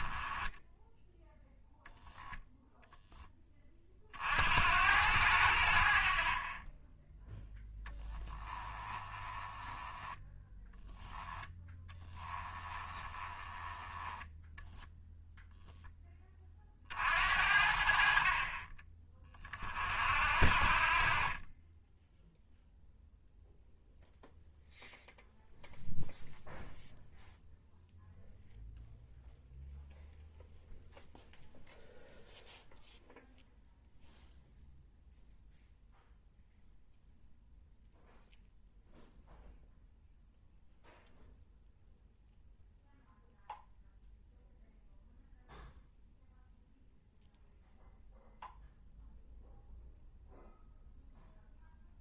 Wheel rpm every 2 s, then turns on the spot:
10, 0, 80, 20, 20, 10, 20, 0, 50, 30, 50, 0, 0, 0, 0, 0, 0, 0, 0, 0, 0, 0, 0, 0, 0, 0.
8-14